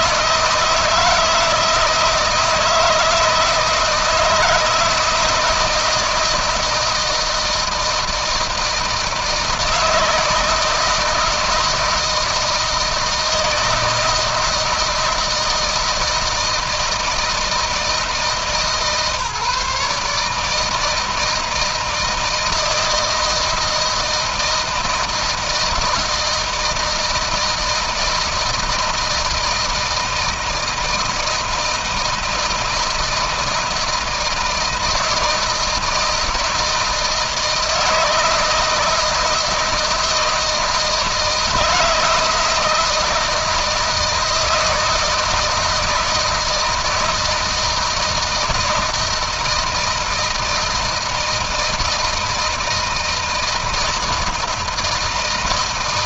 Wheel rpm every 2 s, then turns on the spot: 160, 160, 160, 160, 160, 160, 160, 160, 160, 150, 160, 170, 160, 160, 160, 160, 160, 160, 160, 160, 160, 160, 160, 160, 160, 160, 160, 160.
none